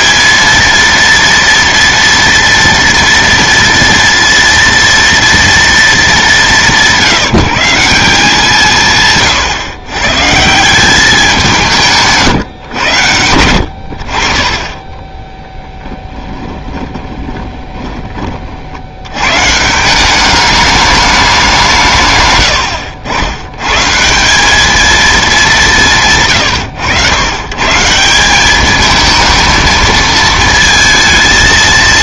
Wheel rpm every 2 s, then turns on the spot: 230, 230, 230, 190, 170, 170, 120, 30, 20, 50, 210, 110, 210, 130, 200, 220.
16-18